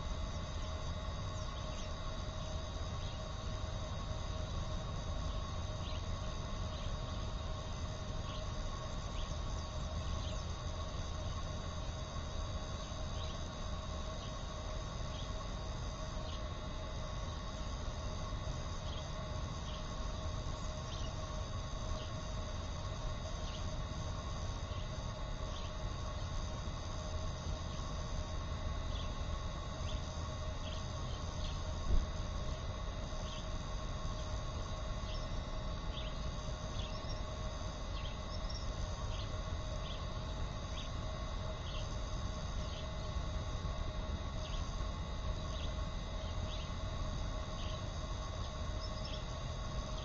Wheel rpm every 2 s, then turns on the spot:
0, 0, 0, 0, 0, 0, 0, 0, 0, 0, 0, 0, 0, 0, 0, 0, 0, 0, 0, 0, 0, 0, 0, 0, 0.
none